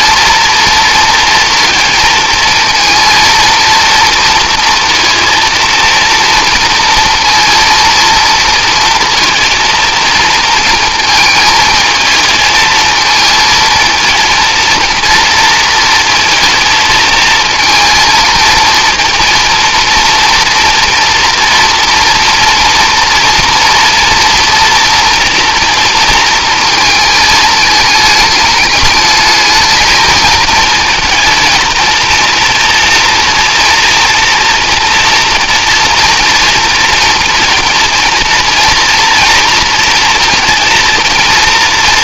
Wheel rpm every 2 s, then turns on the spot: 230, 230, 230, 230, 230, 220, 230, 230, 220, 230, 240, 230, 230, 220, 220, 220, 230, 230, 230, 230, 230.
none